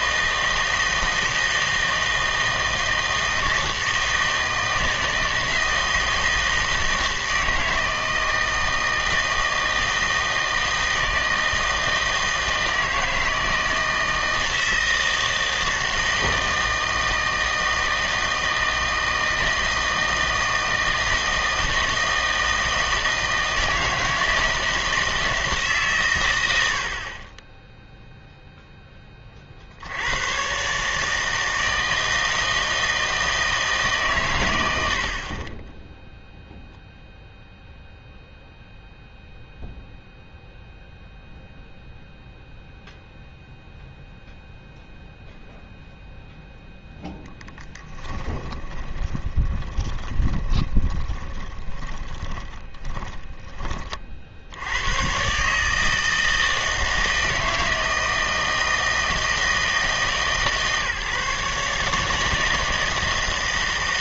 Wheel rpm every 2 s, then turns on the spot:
160, 160, 160, 160, 160, 160, 160, 160, 160, 160, 160, 160, 160, 80, 10, 140, 160, 90, 0, 0, 0, 0, 0, 0, 20, 20, 10, 90, 160, 160, 140, 160.
48-52